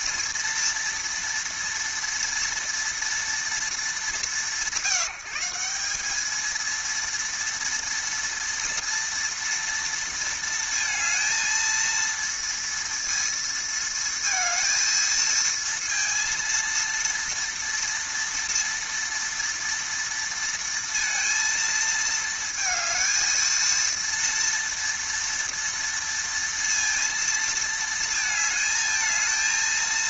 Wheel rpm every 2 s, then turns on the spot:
230, 230, 190, 230, 230, 230, 230, 230, 230, 230, 230, 220, 230, 230, 220.
none